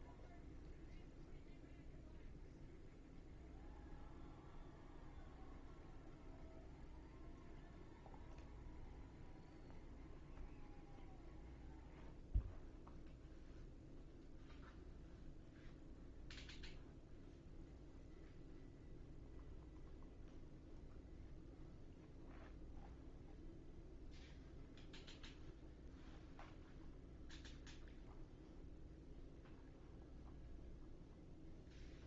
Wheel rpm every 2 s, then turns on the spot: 0, 0, 0, 0, 0, 0, 0, 0, 0, 0, 0, 0, 0, 0, 0, 0.
none